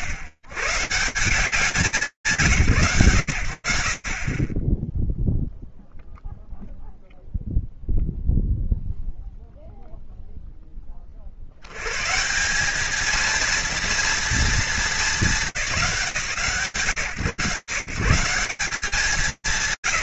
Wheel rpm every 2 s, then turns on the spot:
140, 160, 20, 0, 0, 10, 200, 210, 160, 180.
none